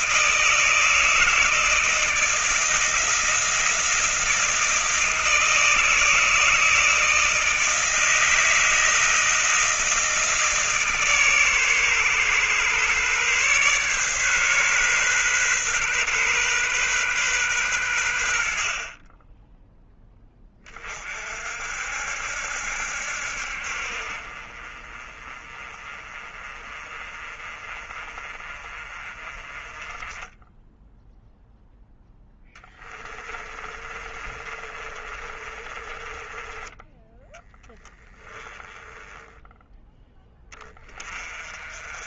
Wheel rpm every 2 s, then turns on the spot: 160, 160, 160, 160, 160, 150, 130, 140, 130, 50, 30, 70, 40, 30, 30, 10, 20, 30, 20, 20, 30.
32-36 38-40